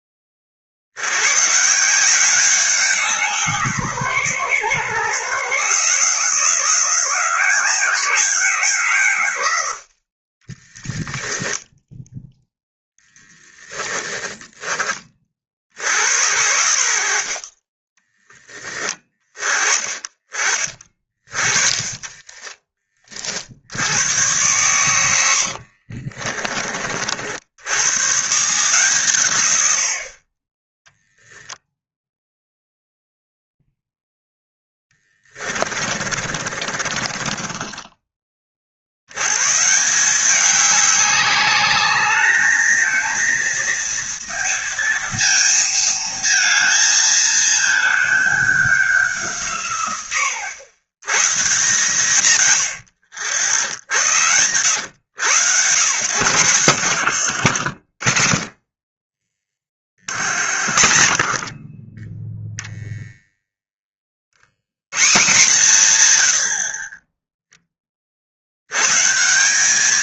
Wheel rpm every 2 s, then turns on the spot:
40, 190, 130, 170, 180, 20, 10, 10, 80, 10, 30, 20, 100, 30, 140, 20, 0, 0, 30, 60, 200, 220, 230, 220, 200, 100, 100, 100, 110, 20, 70, 0, 100, 50, 90.
10-14 22-24 36-38 56-58